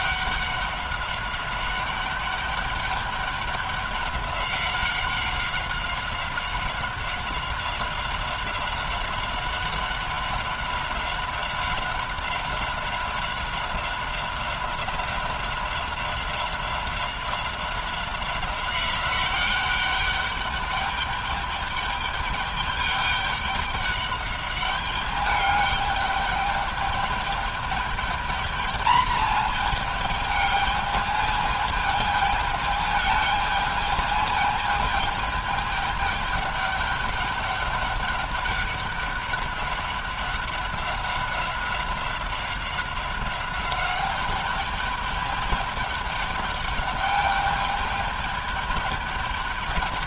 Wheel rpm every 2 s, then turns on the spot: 190, 200, 190, 190, 190, 190, 190, 190, 190, 190, 200, 210, 200, 210, 220, 210, 220, 220, 200, 200, 190, 190, 200, 200, 210.
none